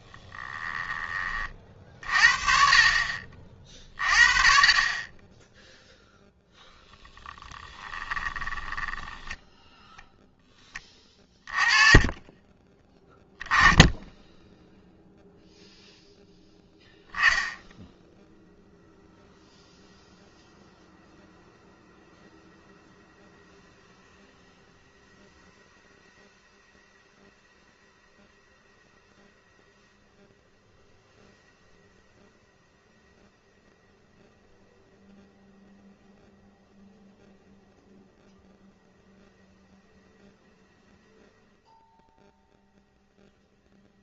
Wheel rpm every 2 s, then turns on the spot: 10, 50, 30, 10, 10, 20, 20, 0, 0, 0, 0, 0, 0, 0, 0, 0, 0, 0, 0, 0, 0, 0.
8-10